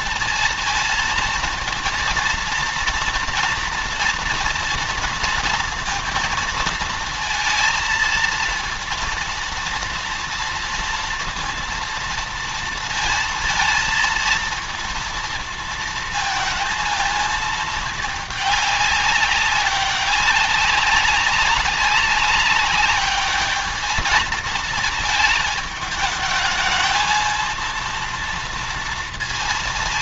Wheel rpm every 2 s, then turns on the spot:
230, 230, 230, 230, 230, 230, 230, 230, 230, 200, 200, 200, 220, 220, 230.
none